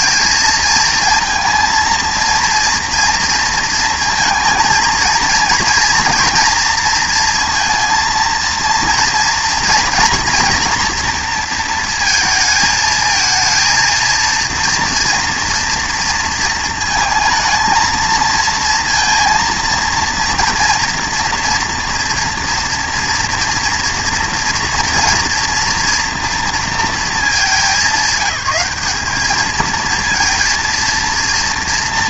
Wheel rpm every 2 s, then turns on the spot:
230, 230, 230, 230, 230, 240, 220, 230, 230, 230, 230, 240, 230, 230, 210, 230.
none